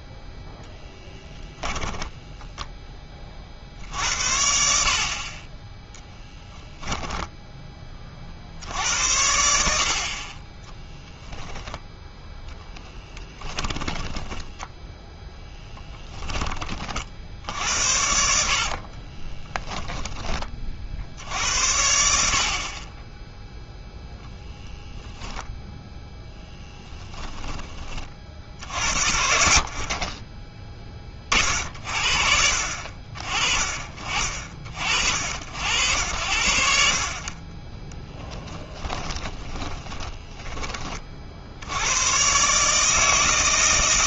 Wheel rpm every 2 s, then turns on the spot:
10, 10, 60, 10, 70, 10, 10, 10, 40, 50, 50, 30, 10, 10, 70, 20, 50, 50, 50, 10, 20, 150.
0-2 6-8 10-16 18-20 26-28 38-40